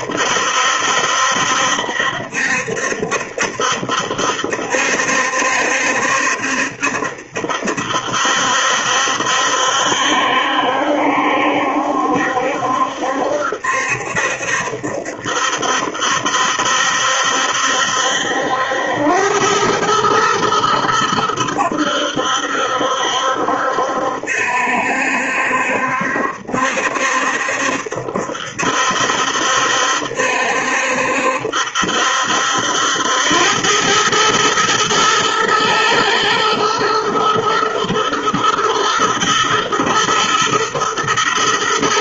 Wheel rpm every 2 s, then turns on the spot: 70, 70, 70, 70, 70, 70, 70, 70, 70, 90, 110, 70, 70, 70, 70, 70, 80, 110, 110, 120, 120.
none